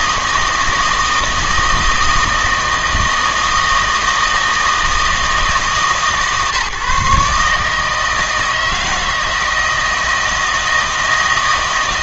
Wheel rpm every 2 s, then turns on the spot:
160, 160, 160, 140, 160, 160.
none